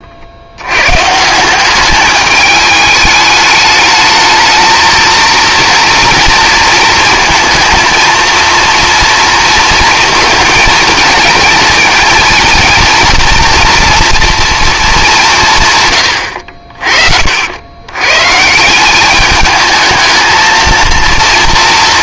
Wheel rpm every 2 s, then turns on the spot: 80, 210, 220, 230, 230, 220, 230, 230, 60, 170, 220.
none